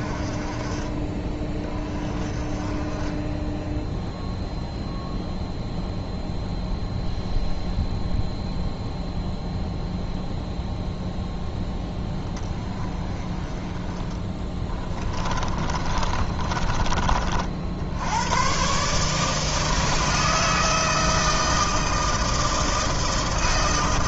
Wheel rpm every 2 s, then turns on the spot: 30, 20, 0, 0, 0, 0, 20, 20, 30, 140, 160, 160.
14-16